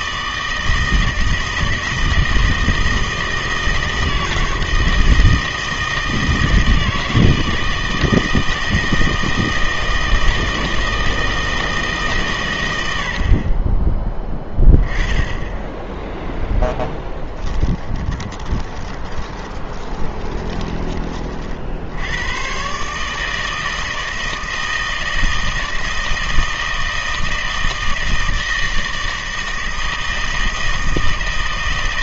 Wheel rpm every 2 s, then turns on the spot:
160, 160, 160, 160, 160, 160, 100, 10, 0, 20, 20, 130, 160, 160, 160, 160.
18-22